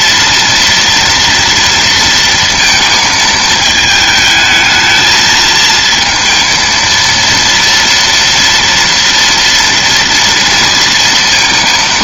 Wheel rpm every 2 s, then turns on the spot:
230, 220, 220, 230, 230, 230.
none